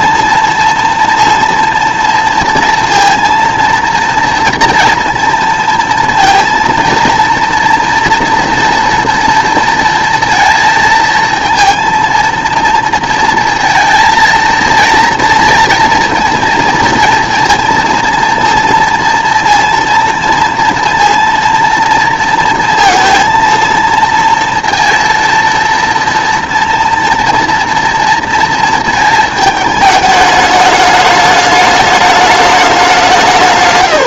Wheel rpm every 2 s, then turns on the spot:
230, 230, 230, 230, 230, 230, 230, 230, 230, 230, 230, 230, 230, 230, 220, 210, 200.
none